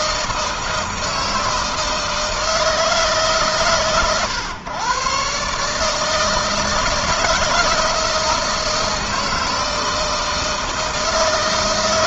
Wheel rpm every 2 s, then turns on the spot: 160, 150, 120, 160, 160, 160.
none